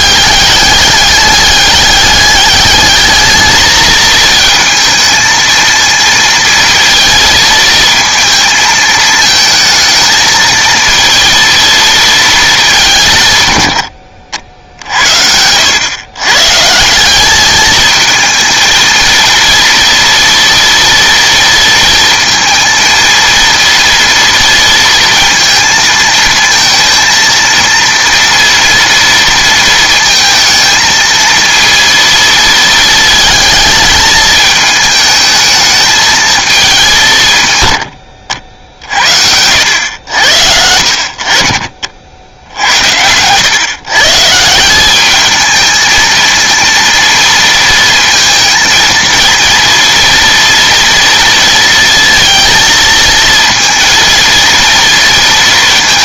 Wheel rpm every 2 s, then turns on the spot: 210, 200, 230, 230, 220, 220, 200, 70, 150, 230, 230, 230, 230, 230, 230, 220, 220, 220, 180, 60, 70, 80, 180, 230, 230, 230, 230, 230.
none